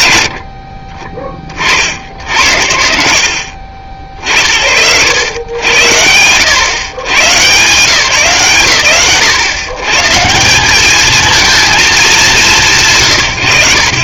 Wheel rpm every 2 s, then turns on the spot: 50, 80, 70, 130, 80, 220, 130.
none